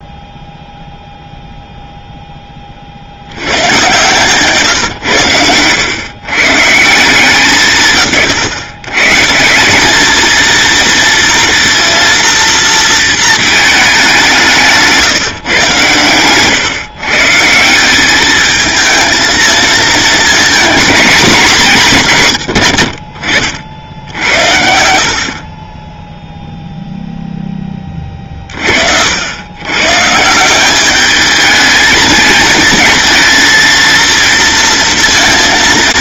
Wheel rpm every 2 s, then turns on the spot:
0, 50, 130, 170, 130, 230, 230, 150, 130, 220, 240, 60, 70, 0, 60, 200, 220, 230.
14-16